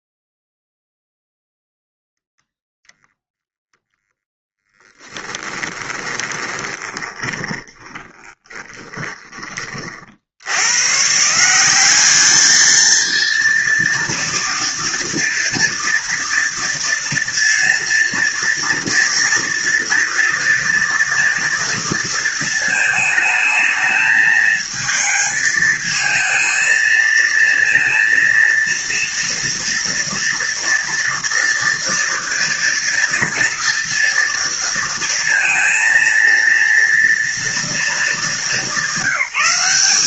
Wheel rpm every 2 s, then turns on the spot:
0, 0, 10, 20, 20, 150, 230, 230, 230, 230, 230, 220, 220, 230, 230, 230, 230, 230, 230, 190.
4-10